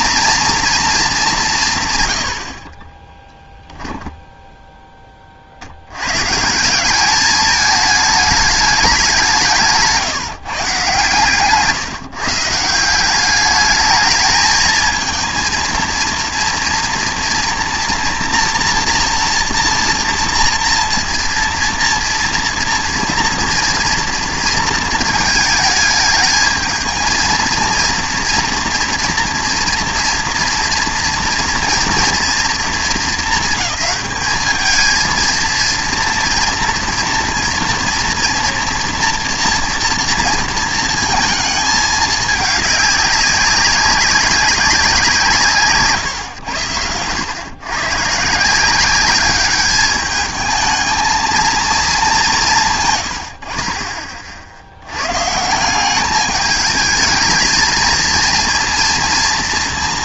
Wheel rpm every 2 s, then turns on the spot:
230, 40, 10, 170, 210, 150, 170, 220, 230, 240, 230, 230, 230, 220, 230, 230, 220, 220, 230, 240, 230, 200, 200, 100, 170, 220, 130, 90, 210, 230.
none